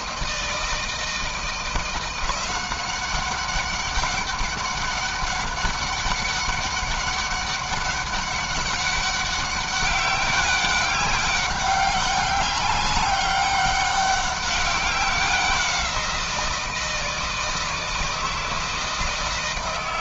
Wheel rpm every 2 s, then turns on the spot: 160, 180, 200, 200, 200, 200, 200, 190, 170, 160.
none